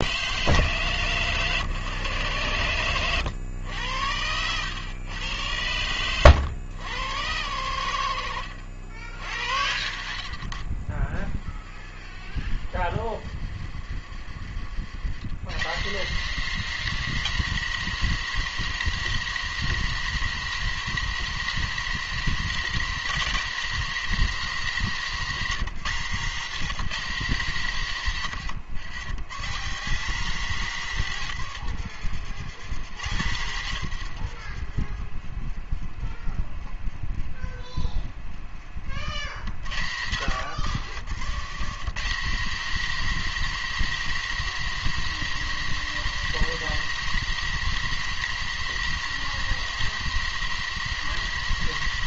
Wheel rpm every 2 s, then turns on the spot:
130, 110, 110, 100, 90, 30, 50, 110, 220, 220, 220, 210, 190, 190, 130, 140, 110, 30, 20, 70, 120, 220, 220, 220, 220, 220.
38-40